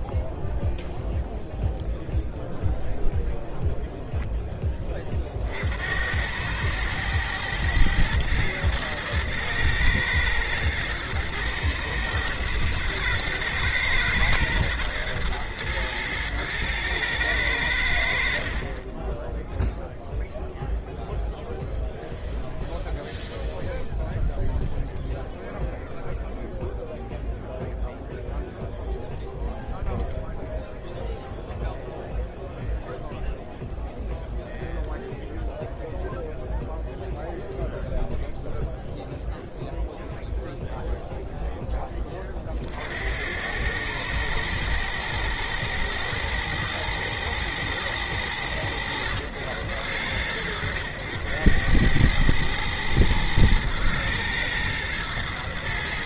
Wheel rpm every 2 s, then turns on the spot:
0, 0, 10, 100, 110, 110, 110, 110, 110, 40, 0, 0, 0, 0, 0, 0, 0, 0, 0, 0, 0, 40, 110, 110, 100, 90, 110, 110.
none